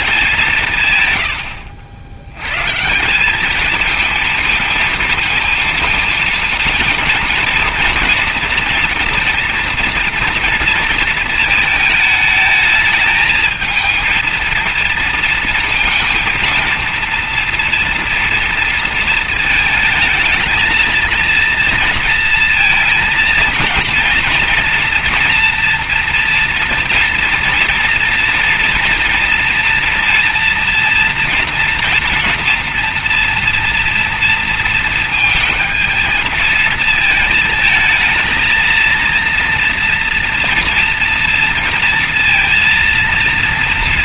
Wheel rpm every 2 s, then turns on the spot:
150, 120, 230, 230, 230, 230, 220, 220, 230, 230, 220, 230, 230, 230, 230, 230, 230, 230, 220, 230, 230, 230.
none